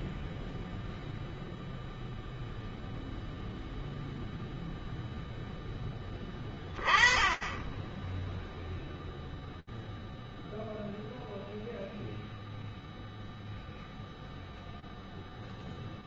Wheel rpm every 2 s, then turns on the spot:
0, 10, 20, 0, 0, 0, 0, 0.
none